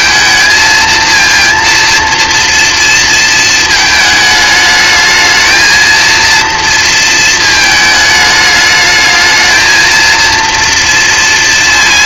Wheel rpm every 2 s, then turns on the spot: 230, 230, 210, 230, 210, 230.
none